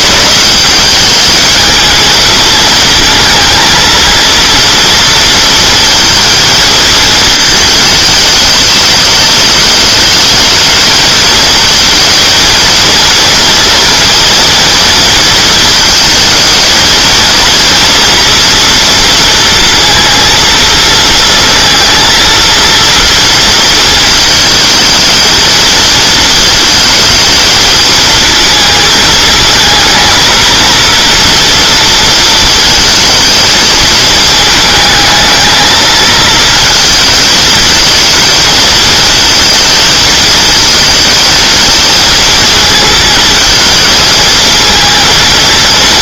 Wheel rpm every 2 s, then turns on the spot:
190, 220, 230, 230, 210, 220, 230, 230, 220, 230, 230, 230, 220, 220, 220, 230, 230, 220, 230, 220, 220, 230, 230.
none